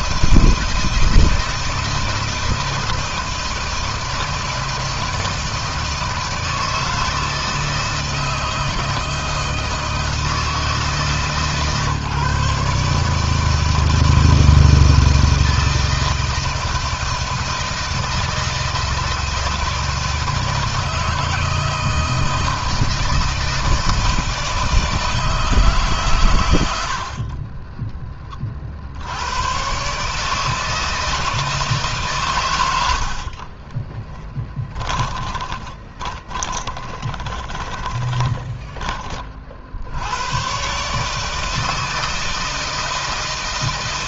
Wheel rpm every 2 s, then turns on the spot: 160, 160, 160, 160, 160, 150, 150, 160, 160, 160, 160, 160, 160, 60, 70, 160, 90, 10, 20, 20, 140, 160.
32-38